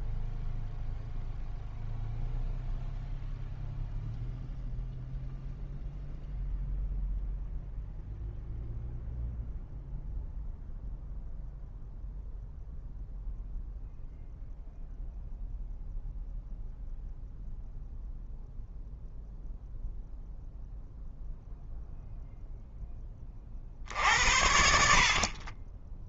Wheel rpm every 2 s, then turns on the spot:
0, 0, 0, 0, 0, 0, 0, 0, 0, 0, 0, 50, 40.
none